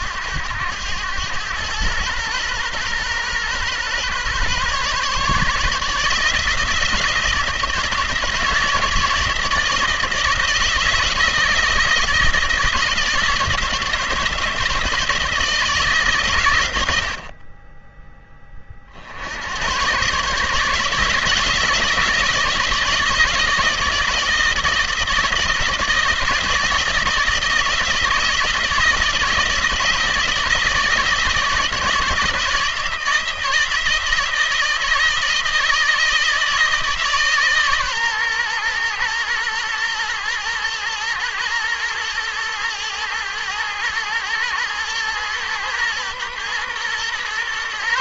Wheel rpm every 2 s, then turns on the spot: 100, 120, 140, 160, 160, 160, 160, 160, 110, 40, 150, 160, 160, 160, 160, 160, 160, 160, 160, 120, 120, 110, 110, 120.
none